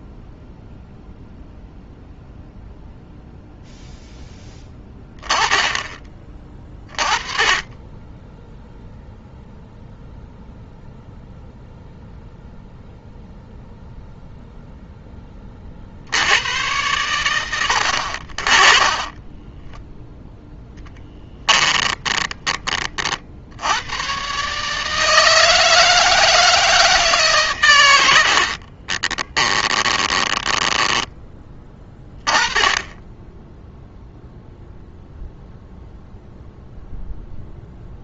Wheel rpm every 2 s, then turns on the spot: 0, 0, 10, 30, 0, 0, 0, 0, 100, 30, 0, 30, 150, 160, 50, 10, 20, 0, 0.
18-20 28-32